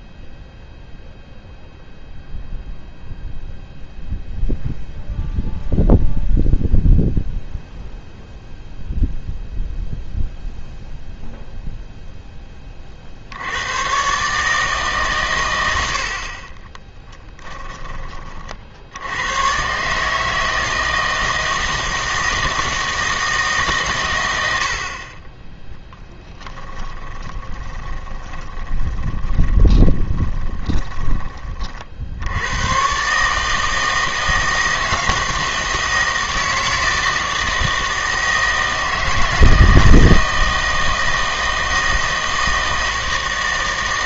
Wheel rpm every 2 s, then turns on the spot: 0, 0, 0, 0, 0, 0, 30, 150, 20, 60, 160, 160, 70, 10, 20, 20, 110, 160, 160, 160, 160, 160.
16-18 26-32